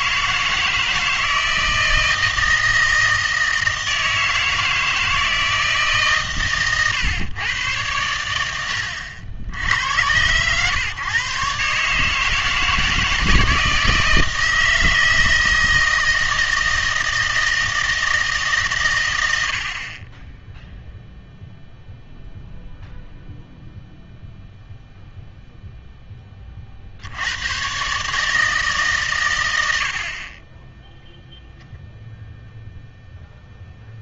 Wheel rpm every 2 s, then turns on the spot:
160, 160, 160, 130, 90, 130, 160, 160, 160, 130, 0, 0, 0, 40, 150, 10, 0.
none